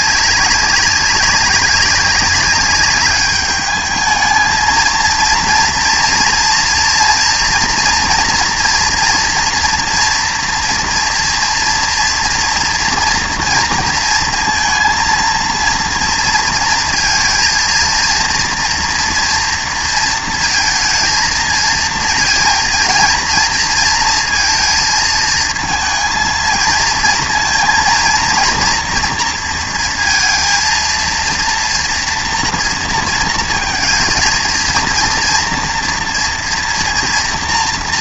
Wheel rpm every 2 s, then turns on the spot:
200, 200, 220, 230, 230, 230, 230, 230, 230, 230, 230, 230, 230, 230, 230, 230, 230, 230, 240.
none